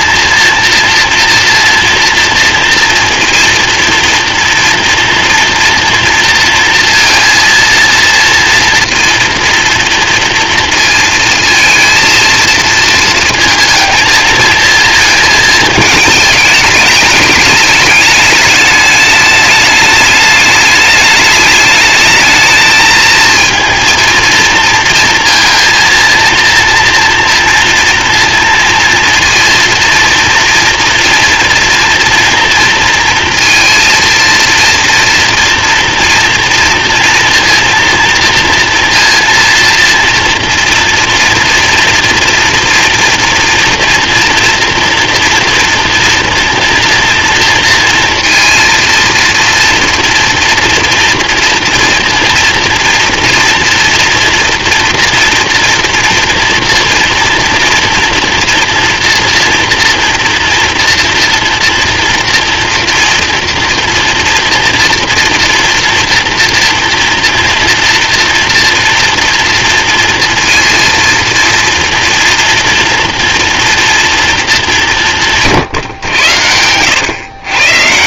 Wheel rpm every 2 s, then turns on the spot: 230, 230, 230, 230, 230, 230, 230, 220, 210, 210, 210, 220, 230, 230, 230, 240, 230, 230, 230, 230, 240, 230, 230, 230, 230, 230, 230, 230, 230, 230, 230, 230, 240, 230, 230, 230, 240, 200, 100.
none